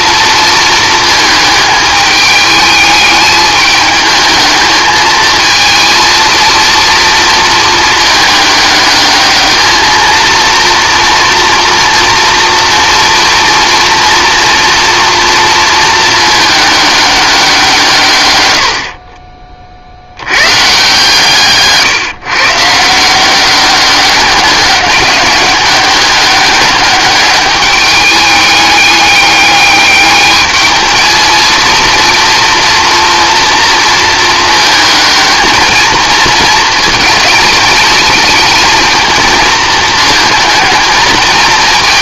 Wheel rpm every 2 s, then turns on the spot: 220, 210, 220, 230, 210, 230, 230, 230, 210, 70, 150, 160, 190, 200, 210, 220, 240, 220, 230, 230, 220.
18-20